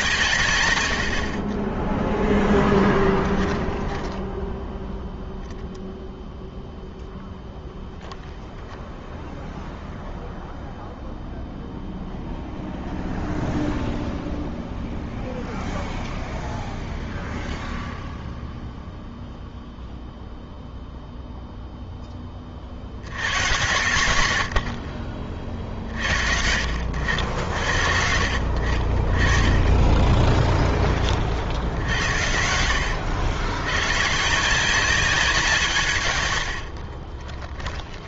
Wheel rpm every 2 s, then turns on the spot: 110, 10, 10, 0, 0, 0, 0, 0, 0, 0, 0, 50, 80, 60, 50, 20, 80, 180, 80.
2-4 36-38